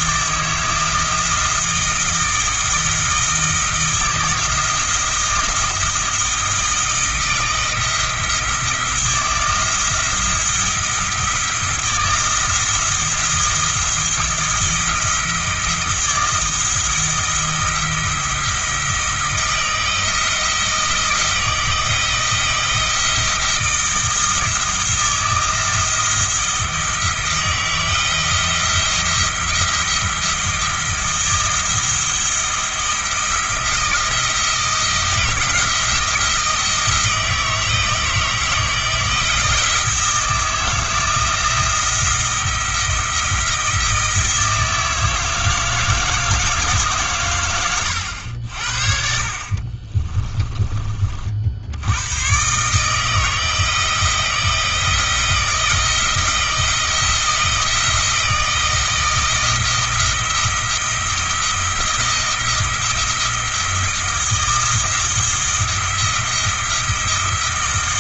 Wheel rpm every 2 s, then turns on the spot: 160, 160, 160, 160, 170, 170, 160, 170, 160, 160, 160, 170, 160, 170, 170, 160, 170, 160, 160, 160, 170, 170, 160, 140, 60, 30, 150, 170, 160, 160, 170, 170, 170, 170.
none